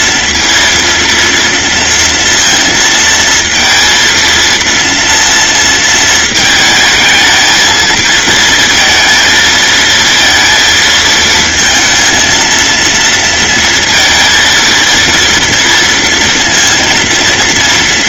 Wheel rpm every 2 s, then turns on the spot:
230, 230, 230, 220, 230, 230, 230, 230, 230.
none